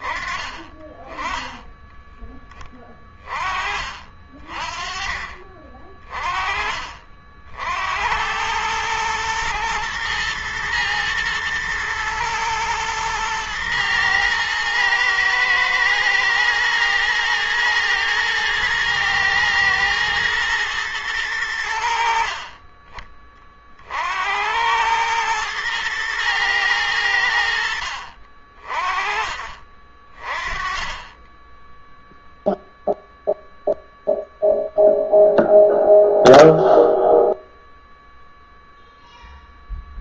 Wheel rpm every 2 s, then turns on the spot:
20, 20, 40, 40, 100, 110, 110, 110, 120, 110, 110, 40, 90, 110, 40, 30, 0, 0, 0, 0.
none